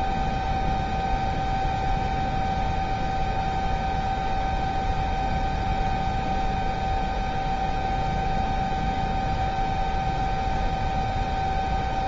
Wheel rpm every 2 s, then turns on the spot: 0, 0, 0, 0, 0, 0.
none